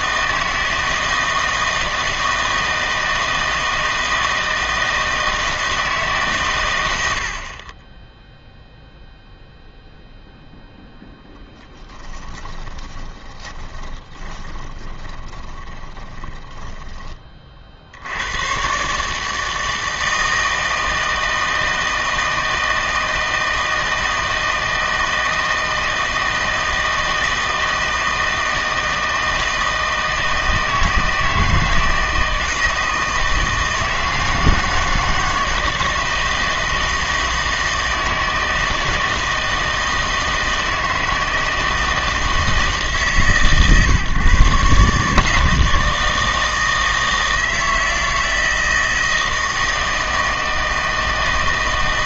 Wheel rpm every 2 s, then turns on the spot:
160, 160, 160, 130, 0, 0, 10, 20, 20, 110, 160, 160, 160, 160, 160, 160, 160, 160, 160, 160, 160, 160, 130, 160, 160, 160.
12-18